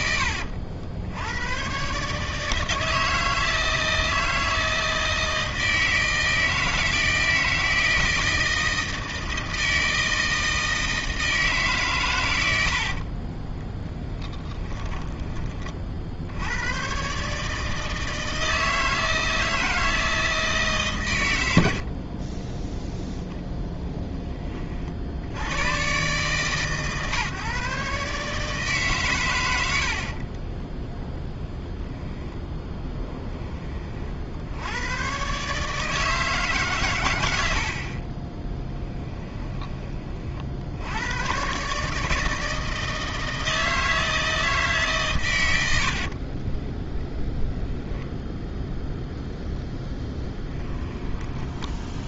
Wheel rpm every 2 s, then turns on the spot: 70, 160, 160, 160, 160, 160, 80, 20, 120, 160, 150, 10, 50, 140, 140, 10, 10, 90, 140, 10, 70, 160, 150, 20, 0, 10.
12-16 30-32 38-40 46-48 50-52